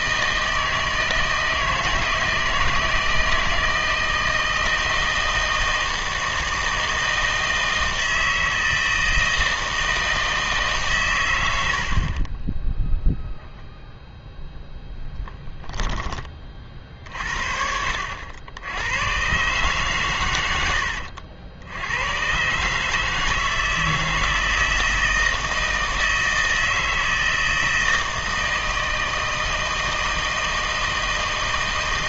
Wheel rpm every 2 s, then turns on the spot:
160, 160, 160, 160, 160, 140, 10, 0, 50, 90, 90, 150, 160, 160, 160, 160.
12-14